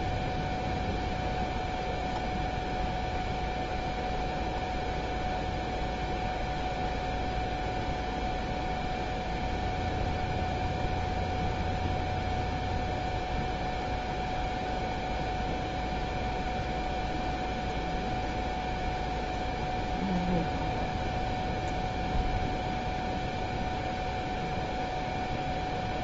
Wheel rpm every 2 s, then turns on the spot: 0, 0, 0, 0, 0, 0, 0, 0, 0, 0, 0, 0, 0.
none